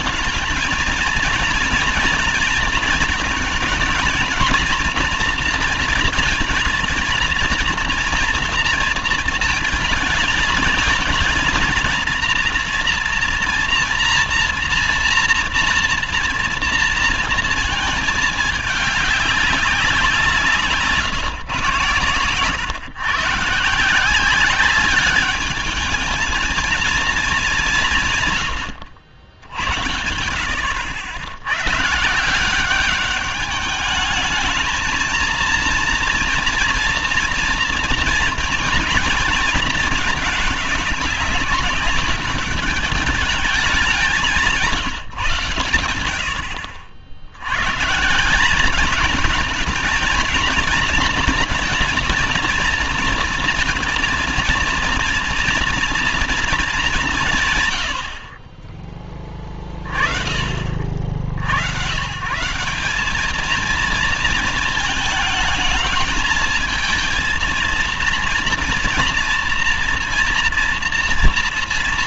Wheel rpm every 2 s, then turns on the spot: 220, 230, 230, 220, 230, 220, 230, 230, 230, 210, 170, 130, 200, 230, 110, 70, 190, 220, 230, 240, 220, 200, 160, 70, 200, 230, 230, 230, 220, 30, 40, 180, 220, 220, 230, 230.
none